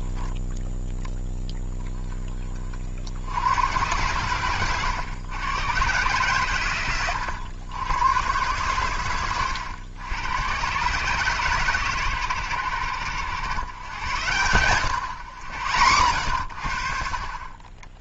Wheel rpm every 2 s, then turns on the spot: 0, 50, 120, 110, 110, 120, 100, 110, 50.
none